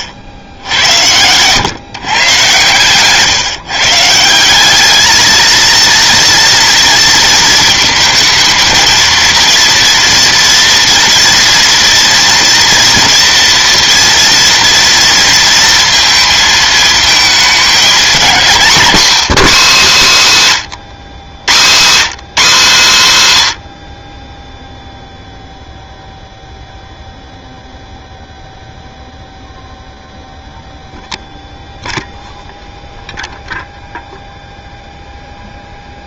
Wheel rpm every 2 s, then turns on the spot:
80, 120, 200, 230, 230, 230, 230, 230, 220, 200, 160, 200, 0, 0, 0, 0, 0, 0.
2-4